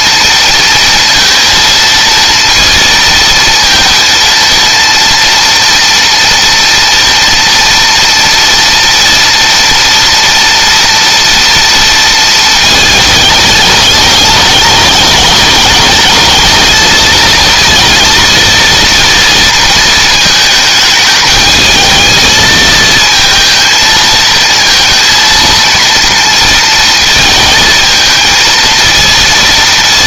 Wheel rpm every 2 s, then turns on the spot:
230, 230, 230, 230, 230, 230, 220, 210, 220, 230, 210, 220, 230, 230, 230.
none